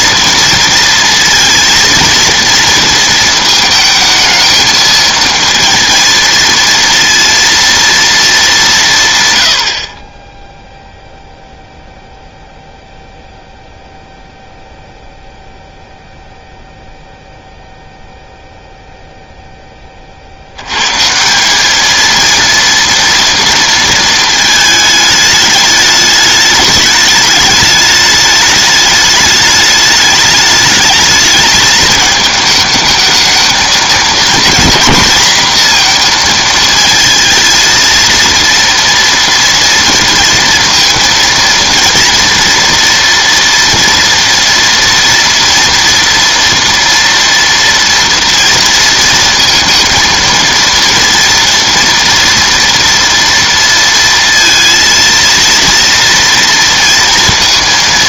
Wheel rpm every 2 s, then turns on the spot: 230, 230, 220, 230, 160, 0, 0, 0, 0, 0, 90, 230, 220, 210, 210, 210, 220, 230, 230, 230, 230, 230, 230, 230, 230, 230, 230, 230, 230.
none